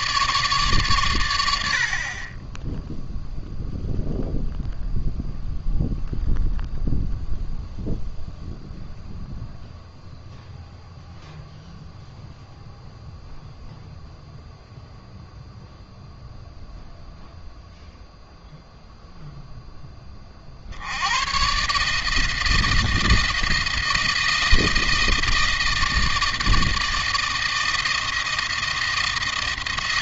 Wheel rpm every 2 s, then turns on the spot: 130, 10, 0, 0, 0, 0, 0, 0, 0, 0, 80, 160, 160, 160, 160.
none